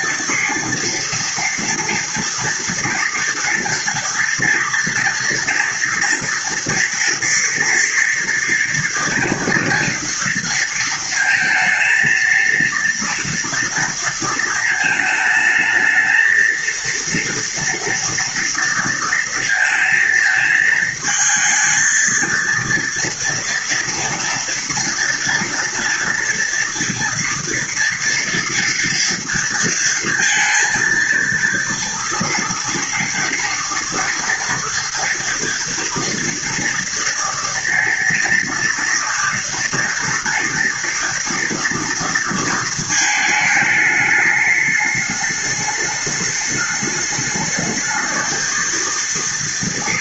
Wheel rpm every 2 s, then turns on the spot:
230, 230, 230, 230, 230, 230, 230, 220, 230, 230, 220, 230, 240, 230, 230, 230, 240, 230, 230, 230, 240, 220, 210, 210, 220.
none